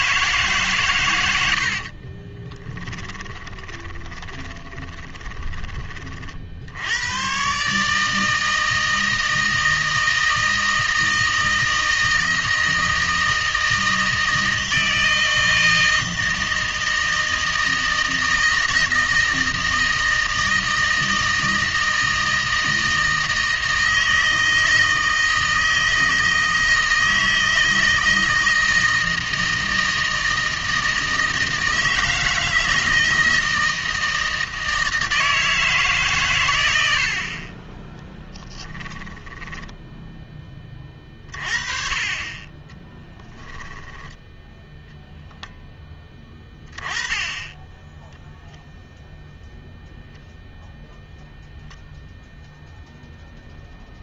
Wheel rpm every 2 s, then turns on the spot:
130, 10, 20, 90, 160, 160, 160, 160, 160, 160, 160, 160, 160, 160, 160, 160, 160, 160, 80, 10, 20, 10, 0, 10, 0, 0, 0.
2-6 38-40 42-44